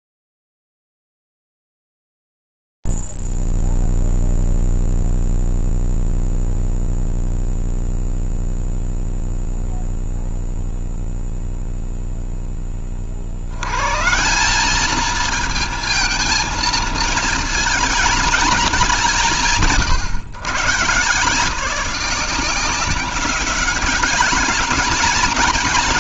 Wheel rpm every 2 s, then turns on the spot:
0, 0, 0, 0, 0, 0, 20, 190, 230, 200, 140, 200, 220.
none